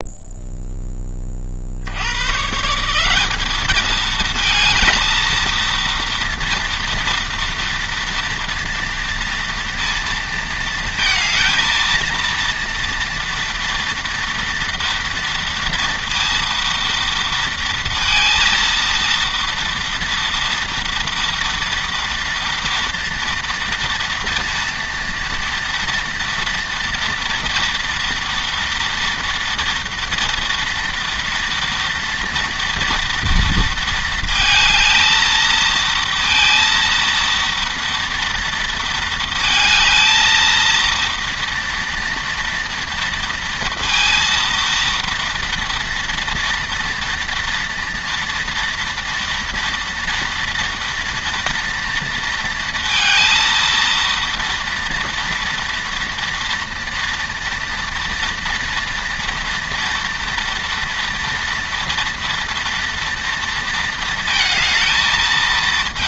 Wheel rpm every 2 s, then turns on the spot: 10, 170, 230, 230, 230, 220, 230, 230, 230, 230, 230, 230, 230, 230, 230, 230, 230, 220, 230, 230, 230, 230, 230, 240, 240, 230, 230, 230, 230, 230, 230, 230, 220.
none